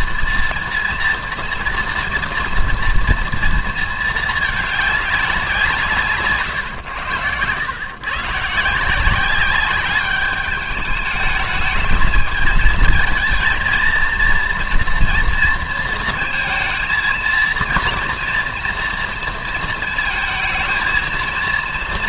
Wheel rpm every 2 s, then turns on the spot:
240, 240, 210, 130, 150, 210, 220, 240, 230, 240, 220.
none